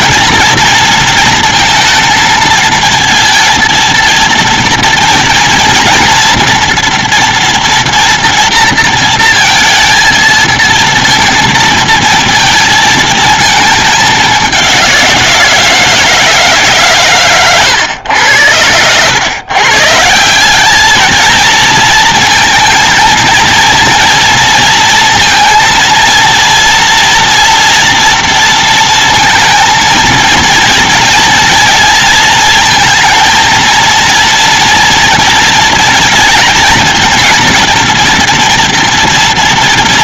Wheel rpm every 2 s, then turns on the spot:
230, 220, 230, 230, 230, 230, 230, 210, 160, 100, 160, 230, 230, 230, 230, 230, 230, 230, 230, 230.
none